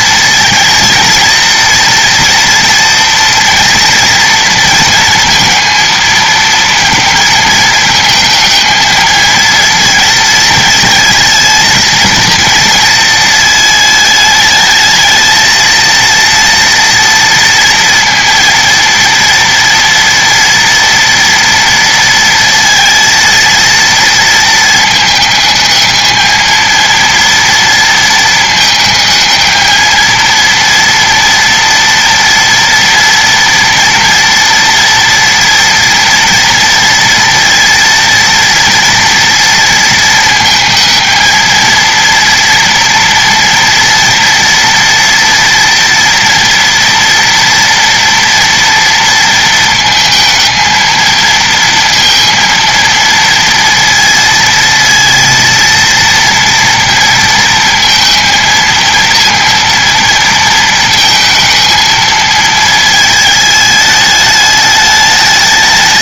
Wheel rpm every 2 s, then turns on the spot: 230, 230, 230, 230, 220, 220, 220, 210, 230, 230, 230, 230, 220, 220, 220, 230, 230, 230, 230, 230, 220, 230, 230, 230, 230, 220, 230, 230, 230, 230, 220, 220, 210.
none